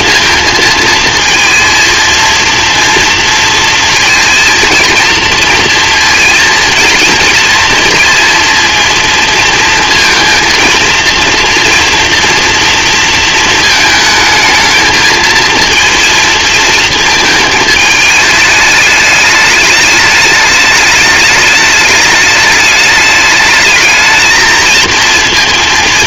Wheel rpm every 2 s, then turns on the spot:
230, 230, 230, 230, 230, 230, 230, 220, 220, 210, 210, 210, 230.
none